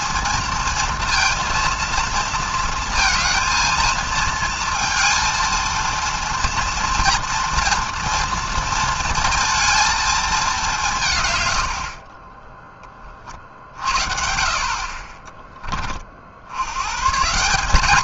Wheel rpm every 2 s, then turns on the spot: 230, 230, 230, 240, 230, 180, 10, 40, 110.
none